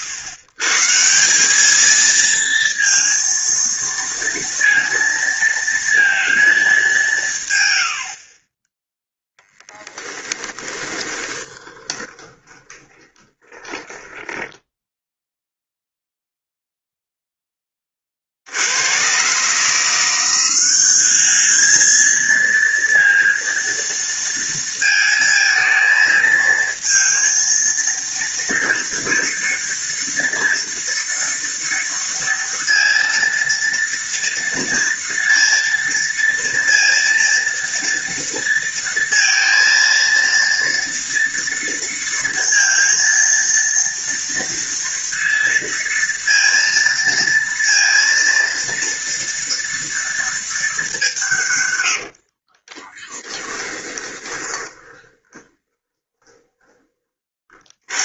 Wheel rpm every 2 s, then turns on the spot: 140, 230, 230, 220, 20, 20, 20, 10, 0, 70, 190, 230, 230, 220, 230, 230, 230, 230, 230, 230, 230, 230, 230, 230, 230, 210, 50, 20, 20.
10-16 52-58